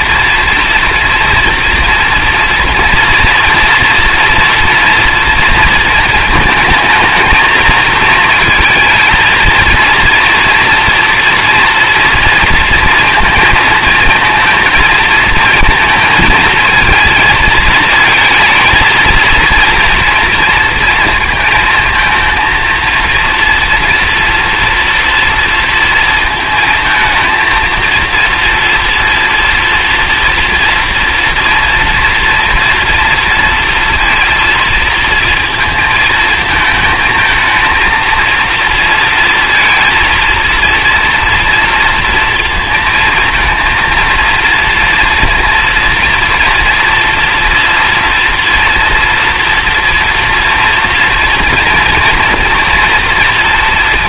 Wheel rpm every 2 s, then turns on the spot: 230, 230, 240, 220, 230, 230, 230, 230, 220, 230, 230, 230, 240, 220, 230, 230, 230, 230, 220, 230, 230, 230, 230, 230, 240, 230, 240.
none